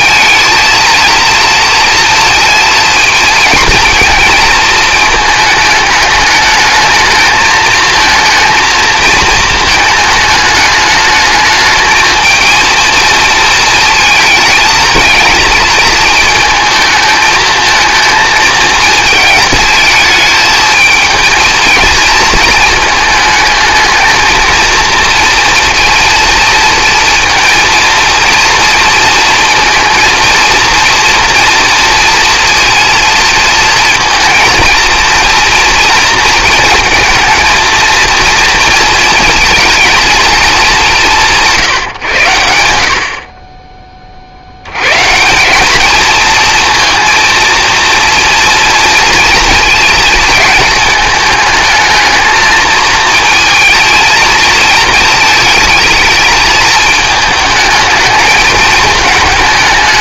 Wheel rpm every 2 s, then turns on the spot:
230, 230, 230, 210, 220, 220, 220, 220, 220, 220, 220, 220, 230, 230, 230, 230, 230, 230, 230, 230, 210, 90, 70, 230, 230, 220, 220, 220, 220, 220.
none